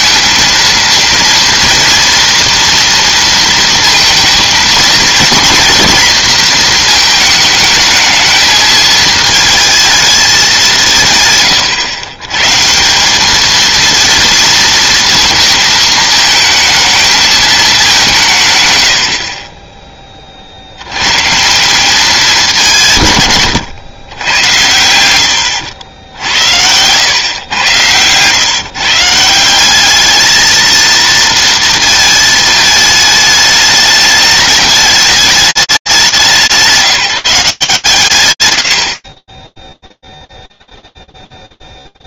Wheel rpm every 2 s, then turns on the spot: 230, 240, 220, 240, 220, 200, 130, 230, 220, 150, 60, 200, 100, 90, 130, 220, 220, 210, 170, 80, 0.
26-28